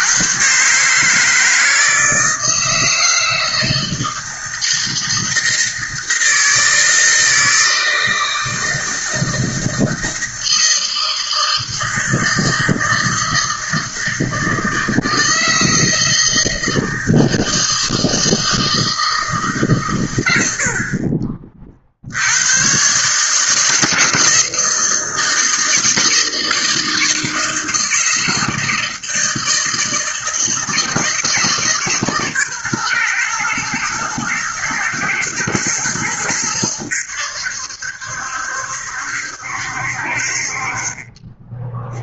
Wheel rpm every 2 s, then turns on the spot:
140, 160, 160, 160, 160, 160, 160, 160, 160, 160, 50, 130, 160, 160, 160, 160, 120, 120, 90, 70, 30.
none